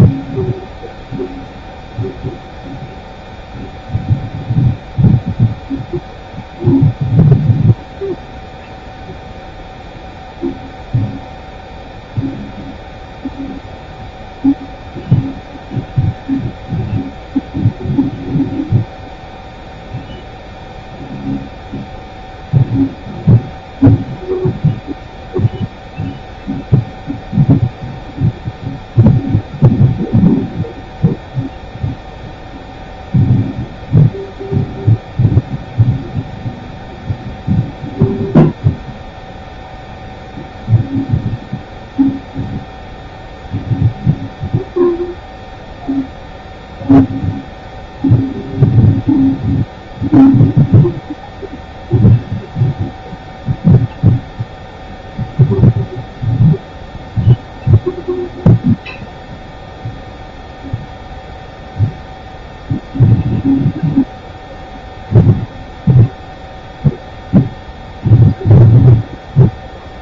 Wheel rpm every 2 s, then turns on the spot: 0, 0, 0, 0, 0, 0, 0, 0, 0, 0, 0, 0, 0, 0, 0, 0, 0, 0, 0, 0, 0, 0, 0, 0, 0, 0, 0, 0, 0, 0, 0, 0, 0, 0, 0.
none